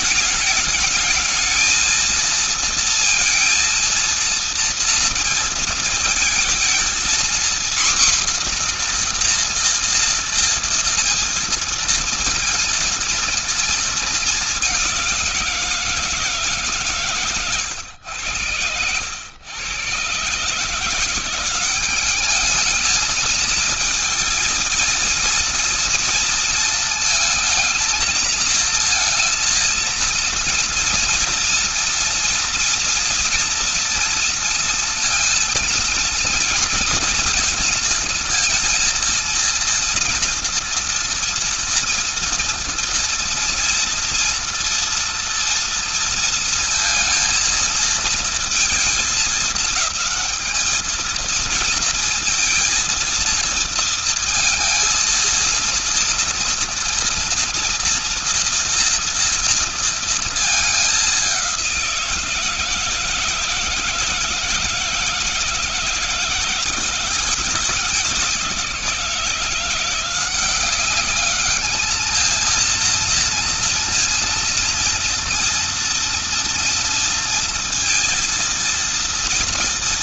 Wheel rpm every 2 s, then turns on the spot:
210, 230, 230, 230, 250, 230, 230, 210, 150, 90, 140, 200, 220, 230, 220, 230, 230, 230, 230, 230, 230, 230, 240, 230, 220, 220, 230, 230, 230, 230, 230, 170, 160, 170, 180, 180, 220, 230, 230, 230.
none